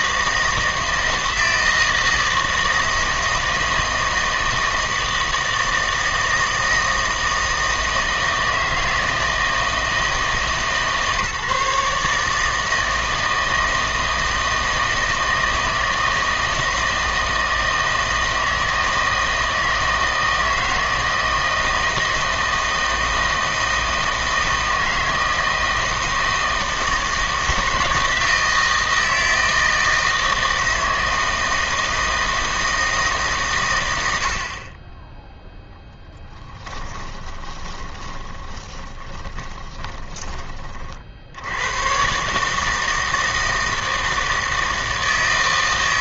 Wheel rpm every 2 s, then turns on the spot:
160, 160, 160, 160, 160, 150, 160, 160, 160, 160, 160, 160, 160, 160, 160, 160, 160, 20, 10, 20, 40, 160, 160.
36-40